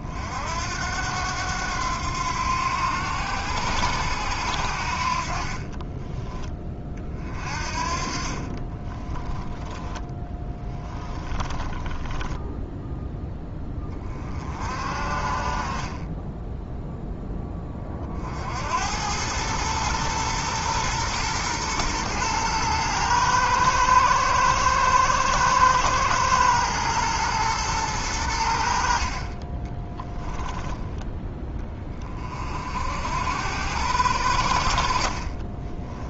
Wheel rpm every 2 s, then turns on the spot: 70, 90, 70, 20, 30, 10, 10, 40, 10, 70, 120, 110, 110, 120, 70, 10, 50, 70.
8-14